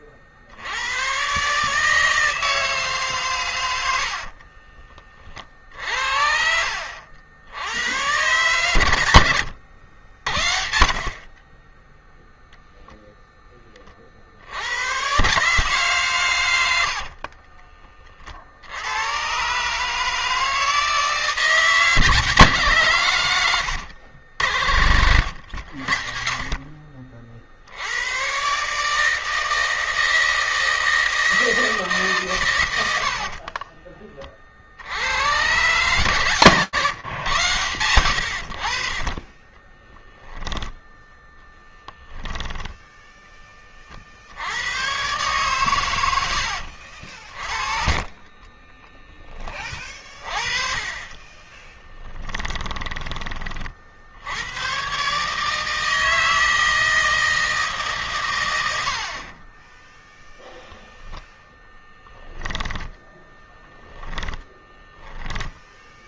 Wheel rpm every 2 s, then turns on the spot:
100, 140, 30, 70, 110, 40, 0, 110, 80, 90, 160, 120, 70, 60, 150, 160, 90, 80, 130, 50, 0, 10, 120, 50, 20, 20, 30, 140, 160, 50, 10, 20, 10.
16-18 32-34 50-52 58-60 62-64